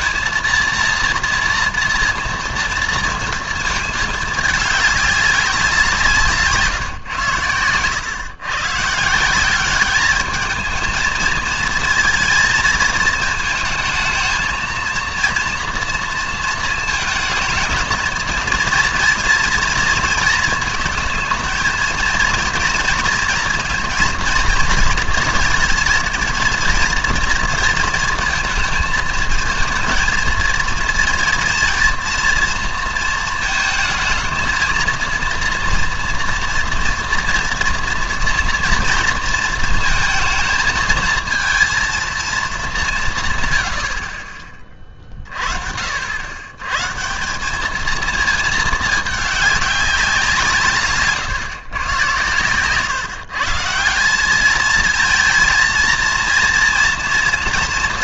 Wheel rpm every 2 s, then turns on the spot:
230, 230, 220, 150, 130, 220, 230, 230, 220, 230, 220, 230, 230, 230, 220, 230, 230, 230, 230, 230, 220, 210, 30, 130, 220, 160, 120, 210, 230.
52-54